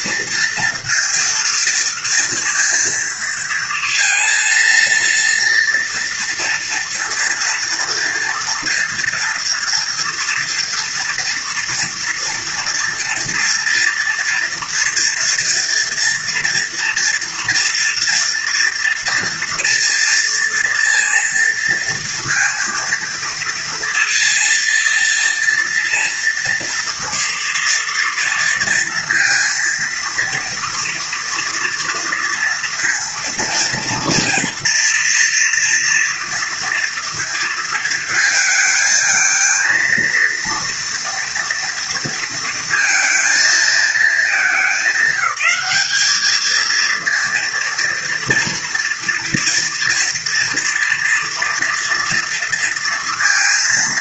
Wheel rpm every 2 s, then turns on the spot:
230, 230, 230, 230, 230, 230, 240, 240, 230, 230, 230, 230, 230, 230, 230, 230, 230, 230, 230, 220, 230, 230, 200, 220, 230, 230, 230.
none